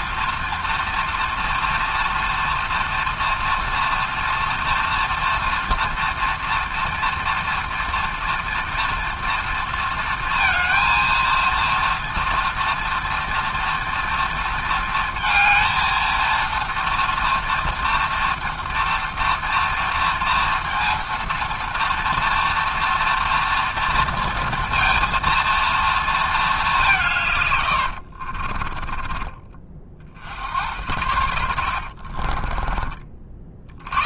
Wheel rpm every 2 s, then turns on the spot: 240, 230, 230, 230, 230, 230, 230, 230, 230, 230, 230, 240, 230, 200, 40, 80, 30.
28-30 32-34